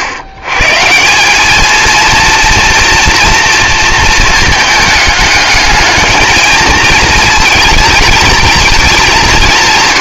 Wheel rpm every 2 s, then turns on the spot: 130, 230, 220, 220, 210.
none